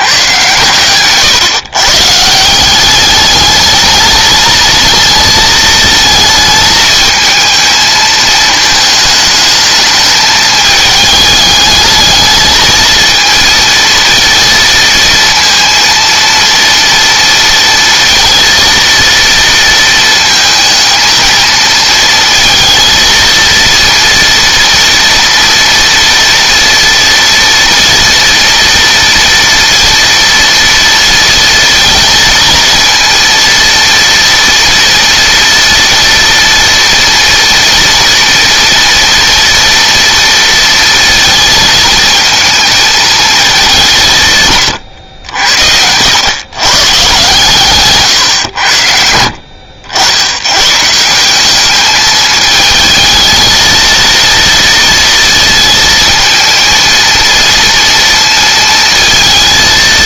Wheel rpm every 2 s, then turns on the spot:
120, 190, 220, 220, 220, 210, 220, 230, 230, 230, 230, 220, 230, 230, 230, 230, 230, 230, 230, 240, 230, 220, 120, 130, 70, 150, 220, 230, 230, 230.
none